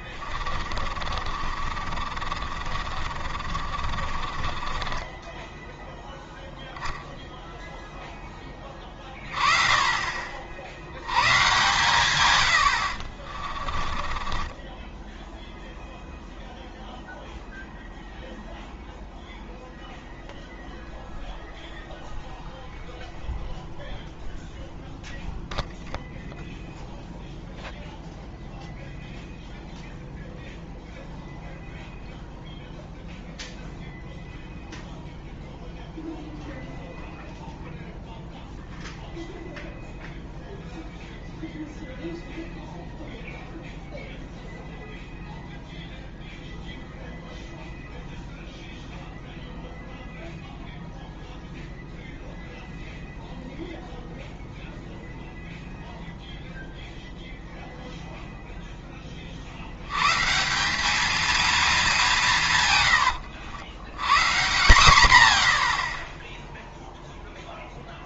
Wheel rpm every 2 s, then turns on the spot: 30, 50, 30, 0, 10, 60, 90, 20, 0, 0, 0, 0, 0, 0, 0, 0, 0, 0, 0, 0, 0, 0, 0, 0, 0, 0, 0, 0, 0, 0, 170, 150, 130, 0.
0-6 14-16